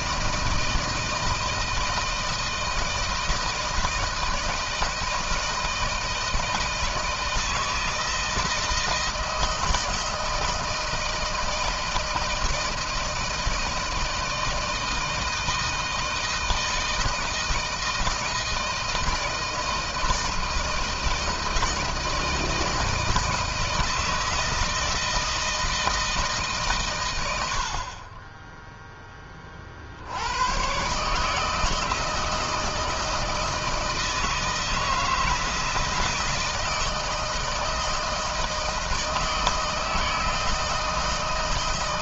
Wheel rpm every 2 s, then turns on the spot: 160, 160, 160, 160, 170, 160, 160, 160, 160, 160, 160, 160, 160, 130, 10, 130, 160, 160, 160, 160, 160.
none